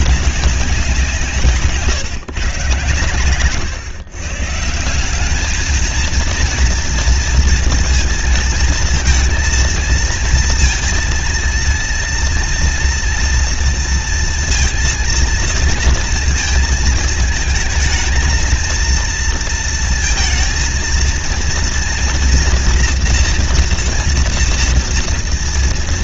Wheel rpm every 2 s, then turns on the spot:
200, 140, 150, 230, 230, 220, 230, 230, 230, 230, 230, 230, 230.
none